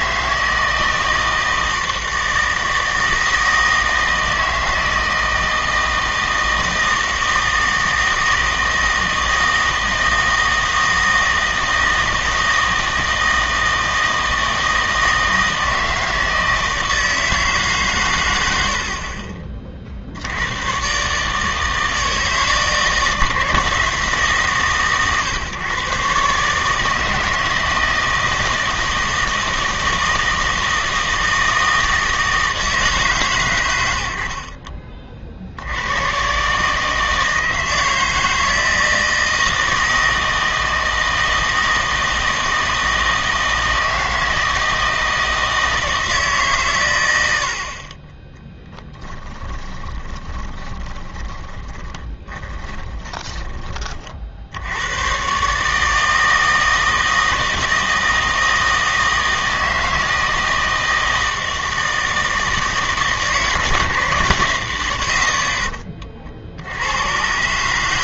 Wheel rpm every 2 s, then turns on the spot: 160, 160, 160, 160, 160, 160, 160, 160, 160, 70, 110, 160, 140, 150, 160, 160, 160, 30, 150, 160, 160, 160, 160, 120, 10, 20, 10, 90, 160, 160, 160, 160, 100, 70.
48-54